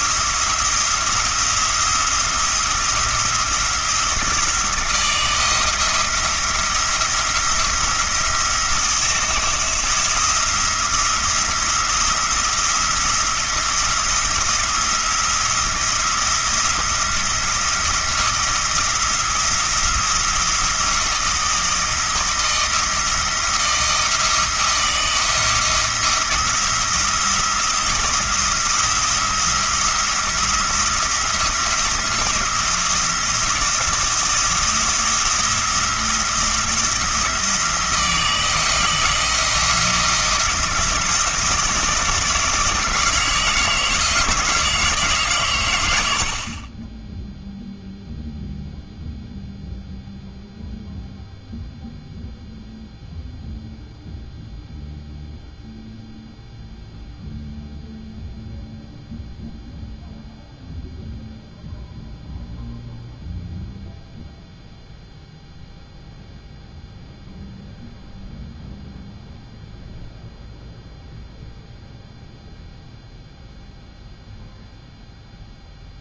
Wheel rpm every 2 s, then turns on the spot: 170, 170, 160, 170, 170, 170, 170, 170, 170, 170, 170, 160, 170, 170, 170, 170, 170, 170, 170, 170, 170, 160, 160, 20, 0, 0, 0, 0, 0, 0, 0, 0, 0, 0, 0, 0, 0, 0.
none